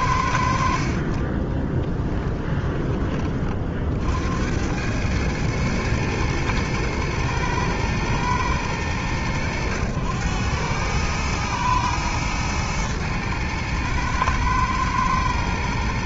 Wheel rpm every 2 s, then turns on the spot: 30, 10, 100, 110, 100, 110, 110, 110.
0-2